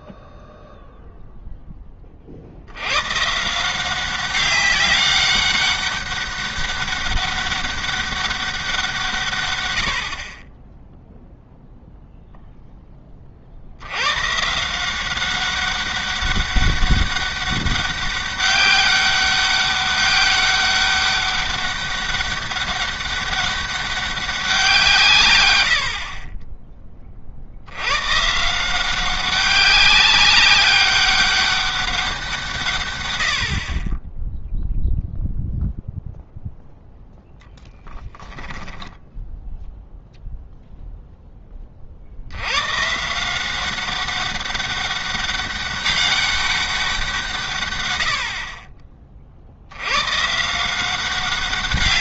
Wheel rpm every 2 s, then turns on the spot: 0, 90, 200, 200, 180, 10, 10, 160, 200, 200, 200, 200, 180, 20, 170, 200, 150, 0, 0, 10, 0, 120, 200, 190, 40, 170.
38-40